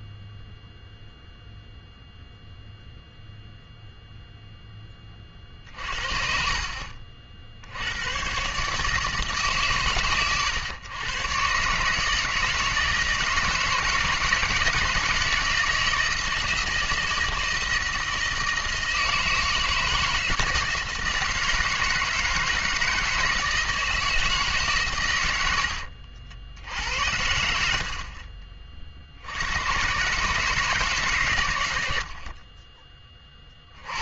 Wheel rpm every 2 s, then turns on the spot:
0, 0, 0, 50, 130, 120, 160, 170, 160, 160, 160, 160, 150, 80, 40, 150, 40.
28-30